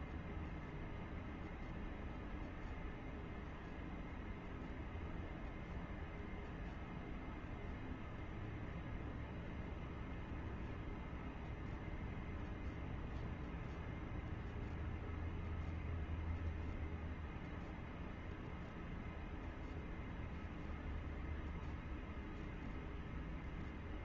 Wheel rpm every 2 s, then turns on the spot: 0, 0, 0, 0, 0, 0, 0, 0, 0, 0, 0, 0.
none